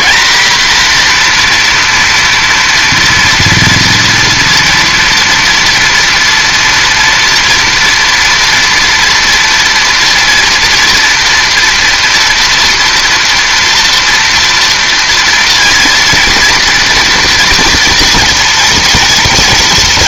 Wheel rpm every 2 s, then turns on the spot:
240, 230, 240, 240, 230, 230, 230, 230, 230, 230.
none